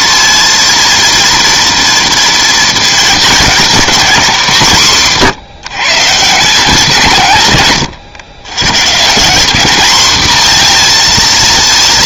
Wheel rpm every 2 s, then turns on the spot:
230, 230, 190, 160, 140, 230.
none